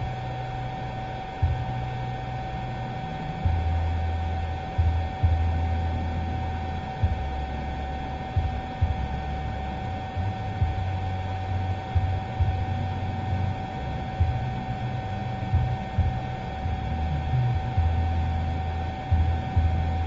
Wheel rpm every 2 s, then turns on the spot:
0, 0, 0, 0, 0, 0, 0, 0, 0, 0.
none